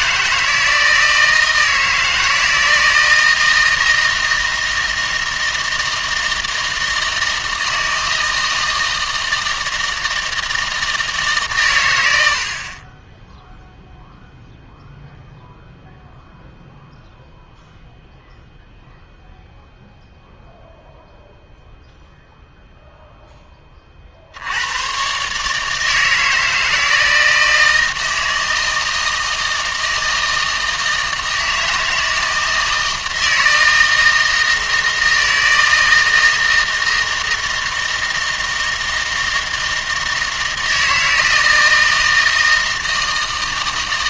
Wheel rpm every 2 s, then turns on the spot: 160, 160, 160, 160, 160, 160, 30, 0, 0, 0, 0, 0, 110, 160, 160, 160, 160, 160, 160, 160, 160, 160.
none